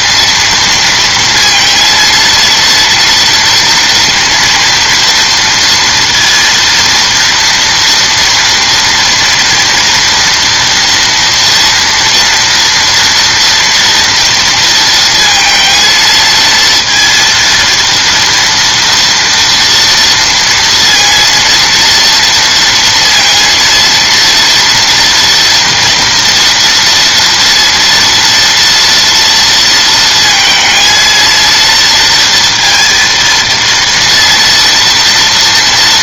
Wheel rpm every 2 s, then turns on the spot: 230, 230, 240, 230, 230, 230, 230, 230, 230, 230, 230, 230, 230, 230, 230, 230, 230, 230.
none